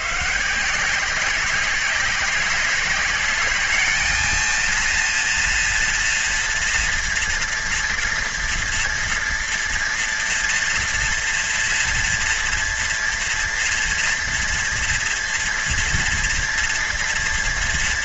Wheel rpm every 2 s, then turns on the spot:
170, 200, 230, 230, 230, 230, 230, 230, 230.
none